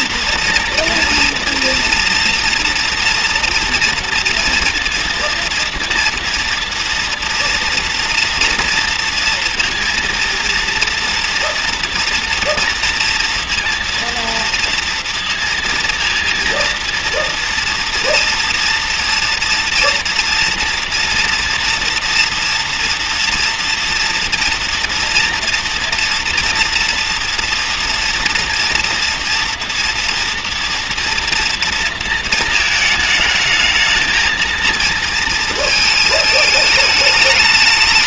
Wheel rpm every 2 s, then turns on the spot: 230, 230, 230, 230, 230, 230, 230, 230, 230, 240, 230, 230, 230, 240, 230, 230, 220, 230, 220.
none